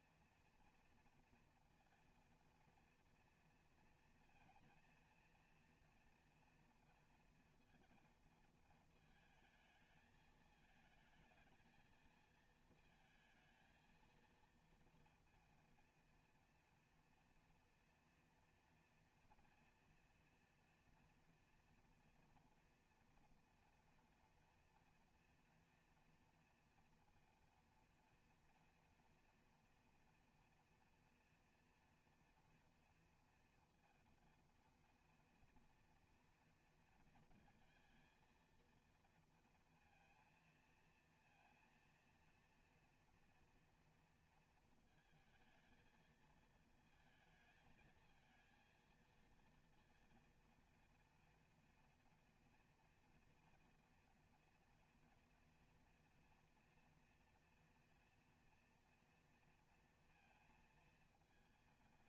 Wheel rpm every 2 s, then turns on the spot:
230, 230, 230, 230, 220, 220, 230, 230, 240, 230, 240, 240, 230, 230, 230, 230, 240, 230, 230, 230, 230, 230, 220, 220, 230, 240, 230, 230, 240, 230, 230.
none